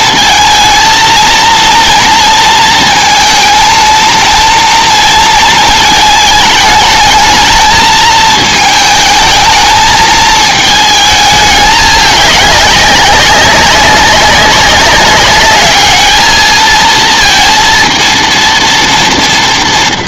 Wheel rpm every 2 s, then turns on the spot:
220, 230, 230, 210, 220, 220, 200, 190, 220, 230.
none